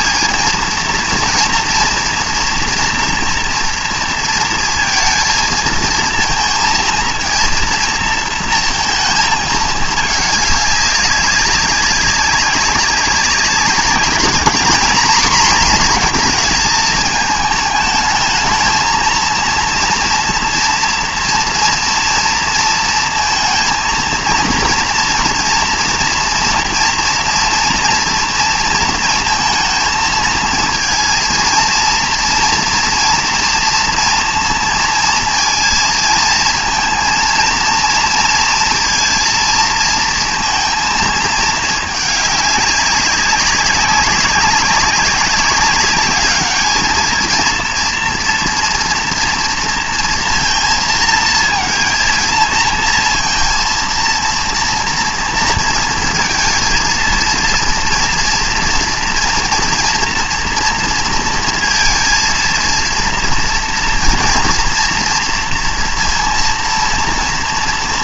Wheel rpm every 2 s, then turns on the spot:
230, 230, 230, 230, 220, 200, 190, 230, 230, 220, 230, 230, 230, 230, 230, 230, 240, 230, 230, 230, 230, 200, 200, 210, 240, 230, 230, 230, 230, 230, 230, 230, 230, 230.
none